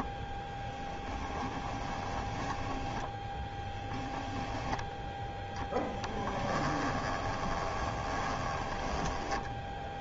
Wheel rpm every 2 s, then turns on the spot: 10, 10, 0, 10, 10.
2-4 6-10